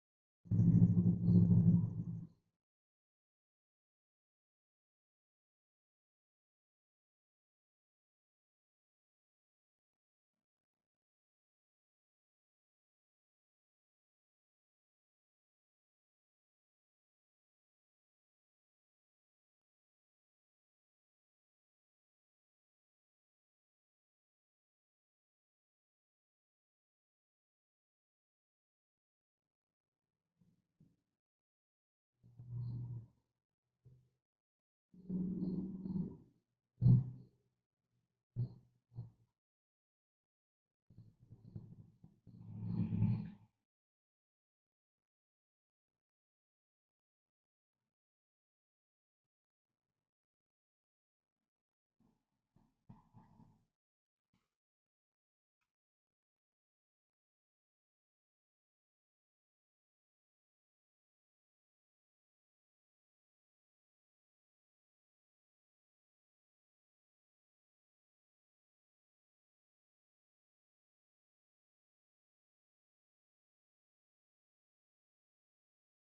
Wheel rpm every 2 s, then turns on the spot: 0, 0, 0, 0, 0, 0, 0, 0, 0, 0, 0, 0, 0, 0, 0, 0, 0, 0, 0, 0, 0, 0, 0, 0, 0, 0, 0, 0, 0, 0, 0, 0, 0, 0, 0, 0, 0, 0.
none